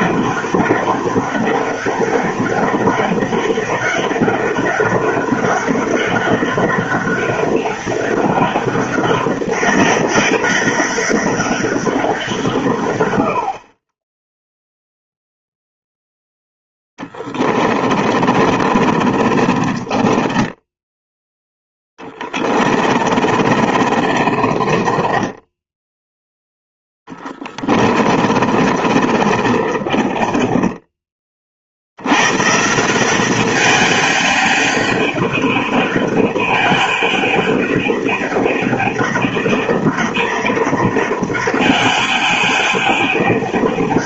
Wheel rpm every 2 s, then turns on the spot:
190, 200, 200, 190, 200, 200, 140, 0, 20, 40, 10, 30, 30, 0, 30, 20, 150, 200, 200, 200, 200, 200.
16-26 28-32